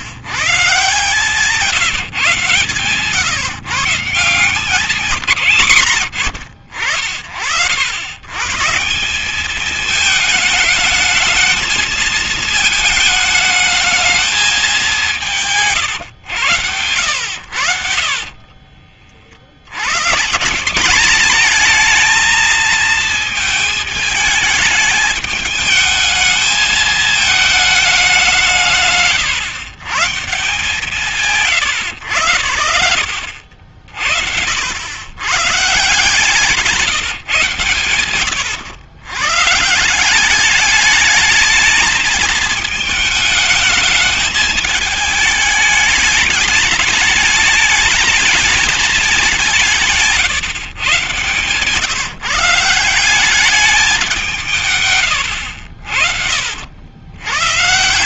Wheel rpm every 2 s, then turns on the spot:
140, 140, 180, 80, 130, 220, 220, 210, 110, 40, 160, 230, 220, 220, 170, 120, 80, 80, 160, 90, 190, 220, 220, 210, 210, 140, 160, 150, 80.
18-20